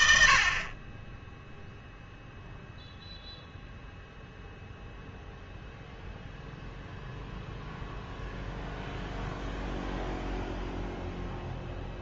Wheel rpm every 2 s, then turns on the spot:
40, 0, 0, 0, 0, 0.
none